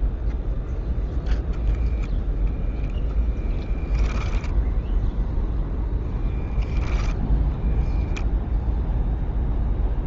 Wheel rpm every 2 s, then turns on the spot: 0, 10, 10, 10, 20.
4-6